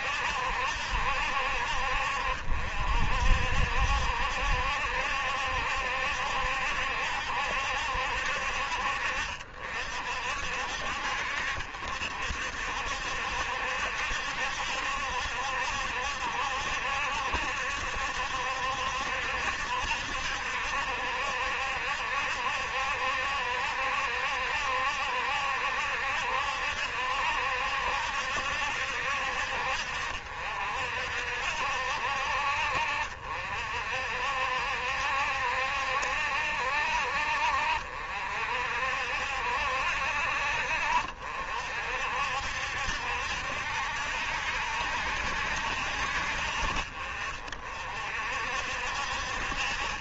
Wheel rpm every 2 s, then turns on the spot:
60, 60, 70, 70, 60, 60, 60, 70, 70, 70, 70, 70, 70, 70, 70, 60, 50, 70, 60, 60, 60, 60, 70, 50, 60.
none